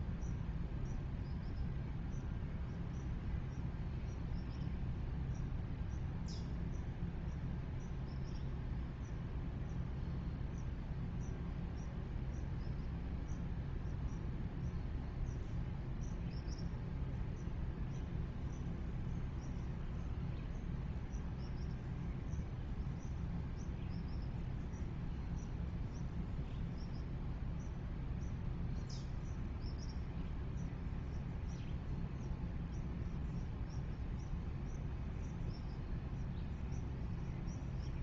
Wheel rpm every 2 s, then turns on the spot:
0, 0, 0, 0, 0, 0, 0, 0, 0, 0, 0, 0, 0, 0, 0, 0, 0, 0, 0.
none